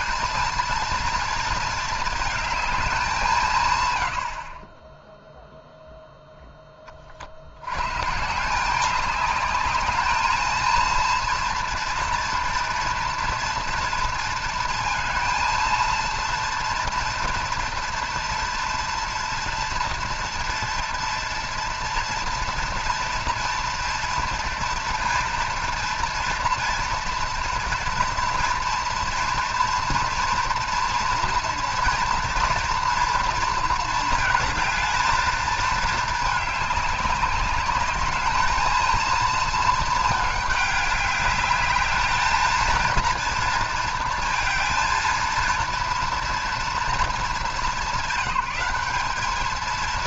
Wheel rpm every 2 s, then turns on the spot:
230, 210, 20, 20, 190, 220, 230, 230, 230, 230, 230, 230, 230, 230, 230, 240, 240, 220, 210, 220, 210, 220, 230, 230, 200.
none